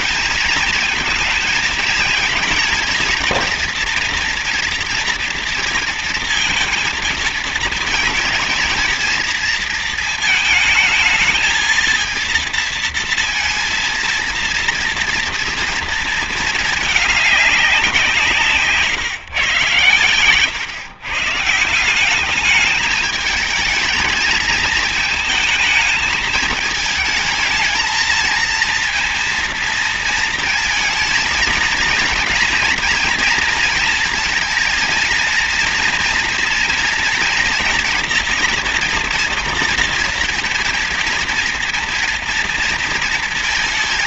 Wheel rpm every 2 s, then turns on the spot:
220, 220, 230, 230, 230, 220, 230, 230, 210, 140, 130, 210, 220, 220, 230, 230, 240, 230, 230, 230, 230, 230.
none